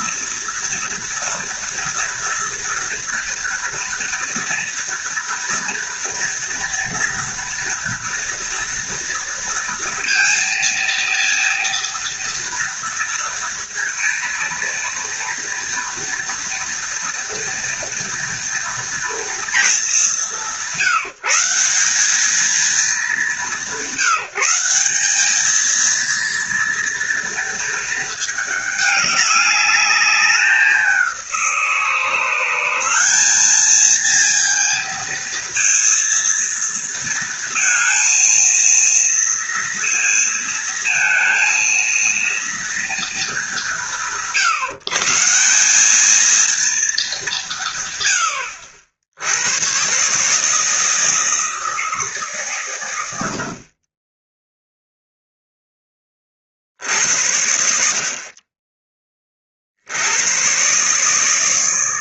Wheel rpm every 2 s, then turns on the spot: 230, 230, 230, 240, 230, 230, 230, 230, 230, 230, 170, 200, 190, 230, 210, 190, 190, 230, 230, 230, 230, 230, 160, 220, 80, 160, 110, 0, 70, 30, 140.
none